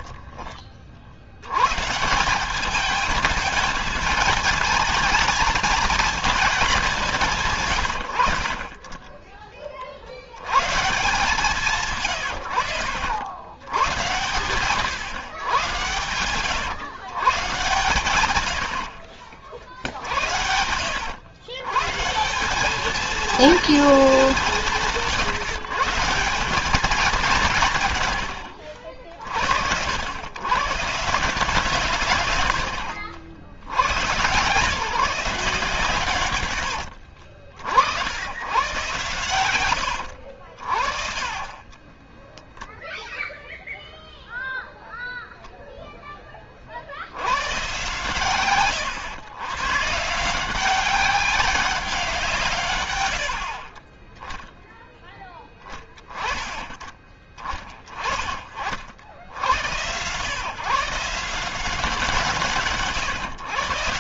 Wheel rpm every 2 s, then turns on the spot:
50, 210, 220, 200, 20, 130, 90, 120, 120, 60, 90, 210, 160, 190, 70, 150, 80, 140, 70, 110, 60, 10, 0, 60, 120, 190, 110, 10, 20, 60, 150, 140.
18-20 36-38 42-44